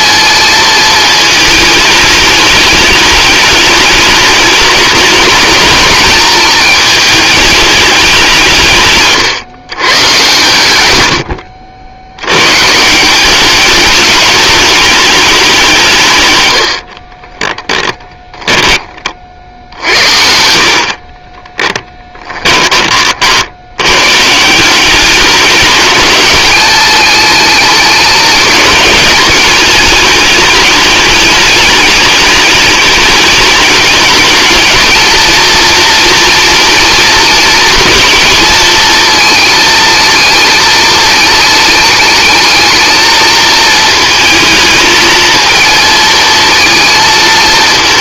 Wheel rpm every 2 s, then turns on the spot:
220, 210, 210, 210, 150, 80, 160, 210, 70, 10, 60, 20, 170, 210, 210, 210, 210, 220, 240, 230, 220, 220, 220, 230.
16-18